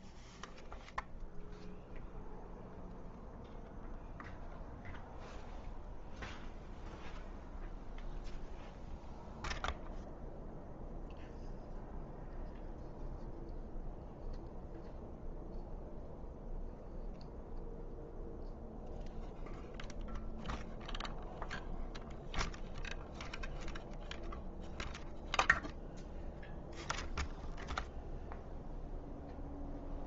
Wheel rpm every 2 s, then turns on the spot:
0, 0, 0, 0, 0, 0, 0, 0, 0, 0, 0, 0, 0, 0, 0.
none